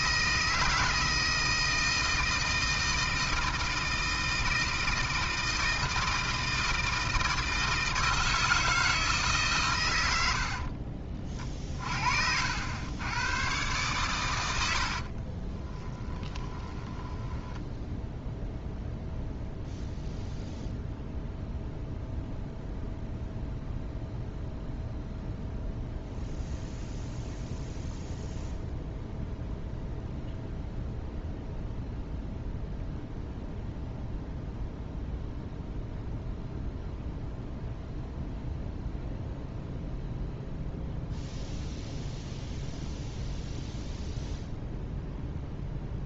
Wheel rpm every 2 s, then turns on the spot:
160, 160, 160, 160, 160, 40, 90, 70, 10, 0, 0, 0, 0, 0, 0, 0, 0, 0, 0, 0, 0, 0, 0.
14-18